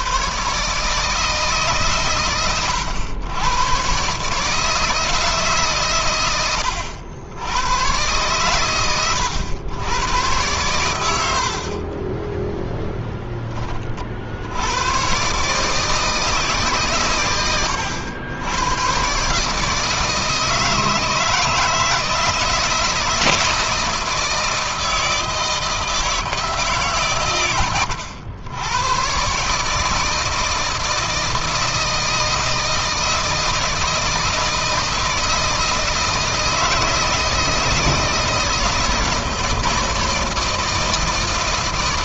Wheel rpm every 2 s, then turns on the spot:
140, 100, 160, 80, 110, 100, 0, 120, 130, 130, 160, 160, 160, 130, 110, 160, 160, 160, 160, 160, 160.
none